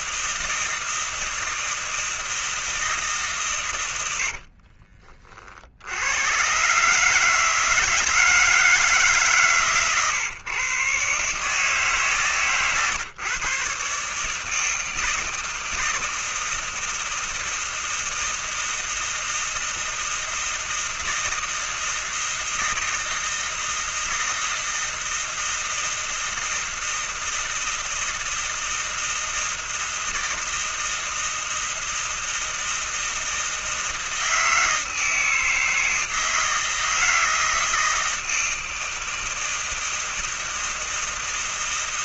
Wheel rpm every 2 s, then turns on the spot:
160, 150, 40, 150, 150, 140, 130, 160, 160, 160, 160, 160, 160, 160, 160, 160, 160, 160, 160, 160, 160.
none